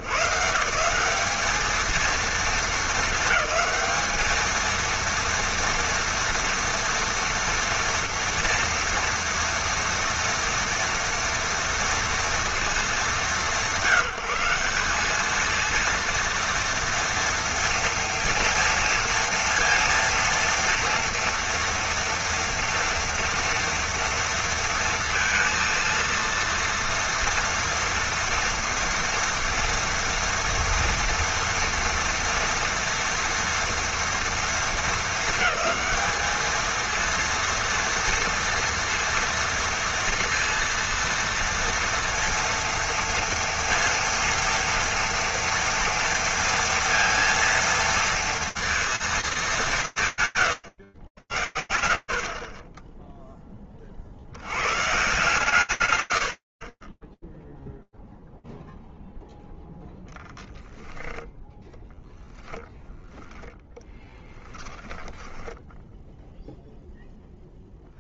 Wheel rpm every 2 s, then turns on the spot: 120, 210, 210, 230, 230, 230, 230, 170, 230, 230, 230, 230, 230, 230, 230, 230, 230, 220, 230, 230, 230, 230, 230, 230, 230, 60, 50, 90, 10, 0, 10, 0, 10, 0.
none